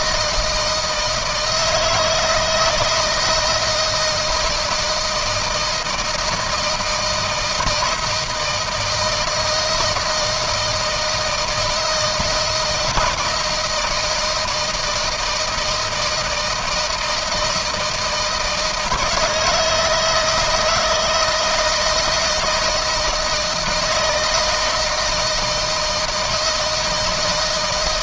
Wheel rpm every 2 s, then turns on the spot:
160, 160, 160, 160, 160, 160, 160, 160, 160, 160, 160, 170, 160, 160.
none